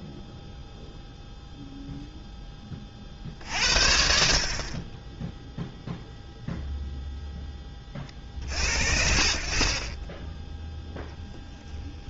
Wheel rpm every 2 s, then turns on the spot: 0, 60, 0, 0, 60, 10.
none